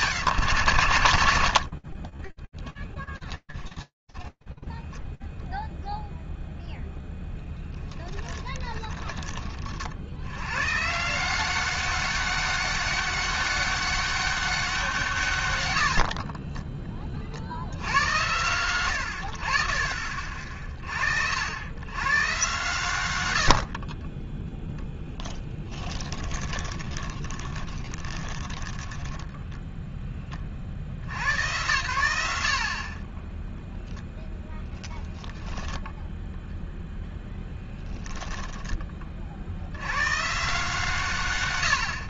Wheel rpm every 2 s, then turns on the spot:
140, 20, 10, 0, 30, 100, 200, 190, 40, 100, 60, 120, 0, 20, 10, 110, 10, 10, 10, 40, 100.
8-10 16-18 26-30 34-38